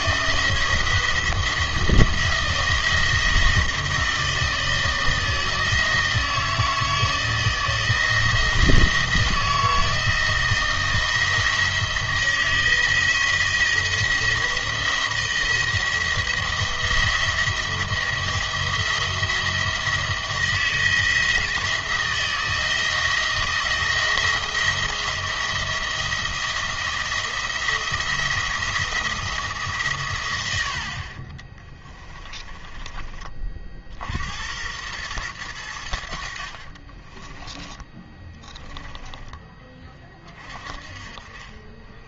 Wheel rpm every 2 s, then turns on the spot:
160, 170, 160, 160, 170, 170, 170, 170, 170, 170, 160, 170, 170, 170, 170, 80, 20, 90, 40, 10, 30.
32-34 36-40